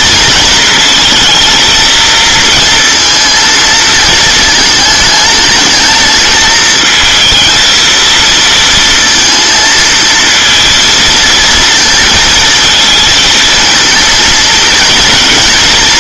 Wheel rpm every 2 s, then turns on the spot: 230, 230, 220, 220, 230, 230, 220, 230.
none